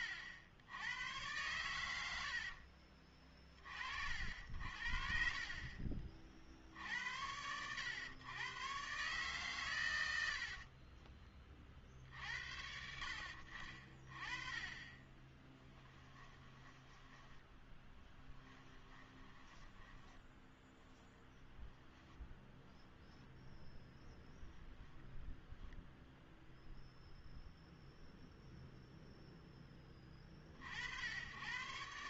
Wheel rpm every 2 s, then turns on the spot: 80, 40, 60, 60, 130, 20, 90, 30, 10, 10, 0, 10, 0, 0, 0, 70.
10-12 16-20